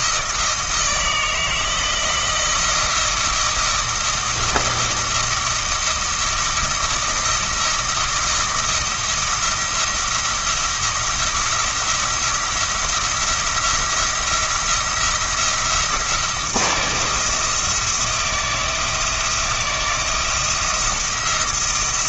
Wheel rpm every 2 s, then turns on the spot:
160, 160, 160, 160, 170, 170, 170, 170, 170, 170, 160.
none